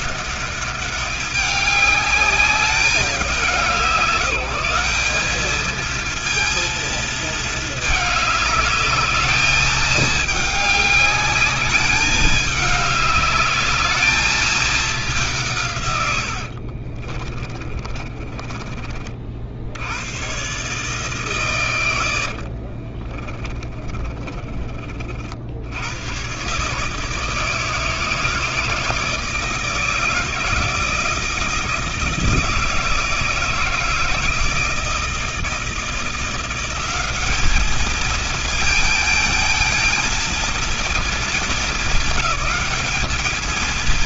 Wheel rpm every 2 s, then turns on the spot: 200, 190, 190, 230, 210, 210, 200, 210, 60, 50, 150, 40, 30, 150, 160, 160, 160, 160, 190, 220, 230, 220.
16-18 22-24